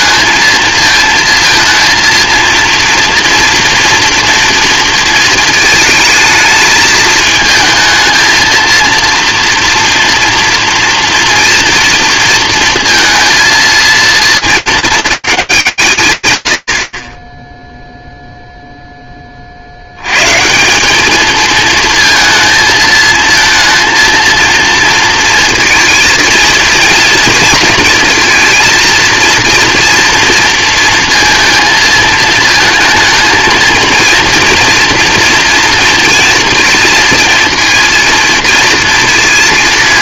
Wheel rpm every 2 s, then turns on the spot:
220, 230, 230, 220, 230, 240, 230, 210, 90, 10, 200, 220, 230, 230, 220, 230, 230, 230, 230, 230.
none